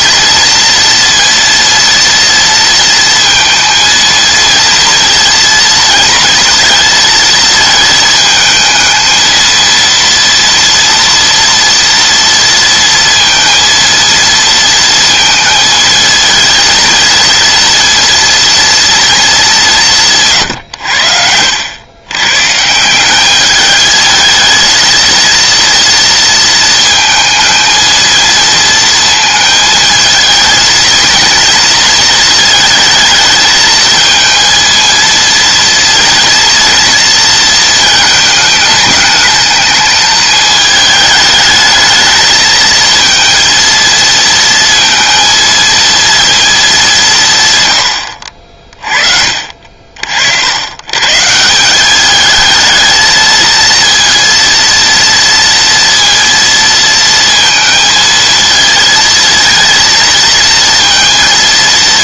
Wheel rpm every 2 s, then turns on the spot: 230, 230, 230, 230, 220, 230, 230, 230, 220, 230, 90, 160, 230, 220, 230, 220, 220, 230, 230, 220, 210, 220, 230, 210, 40, 110, 220, 230, 230, 230, 230.
none